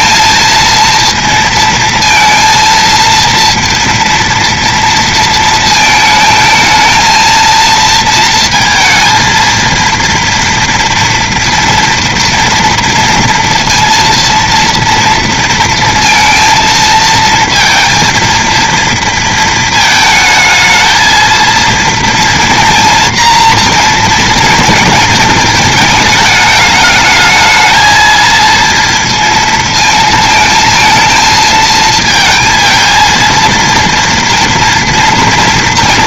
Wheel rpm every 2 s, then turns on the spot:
230, 230, 230, 220, 230, 240, 230, 230, 230, 230, 220, 230, 230, 210, 230, 230, 220, 230.
none